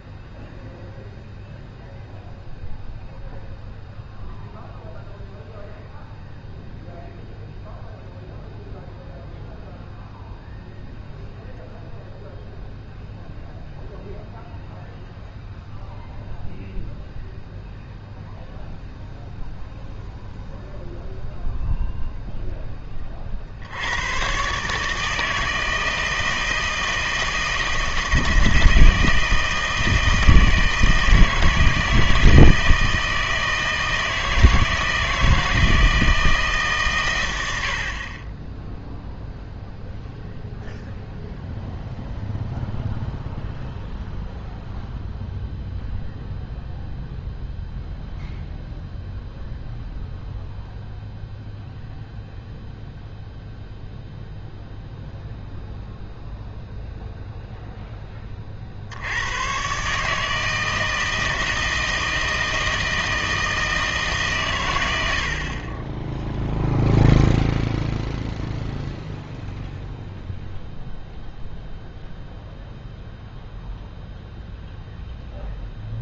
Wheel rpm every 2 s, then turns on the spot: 0, 0, 0, 0, 0, 0, 0, 0, 0, 0, 0, 10, 150, 160, 160, 160, 160, 160, 140, 10, 0, 0, 0, 0, 0, 0, 0, 0, 0, 50, 160, 160, 120, 0, 0, 0, 0, 0.
none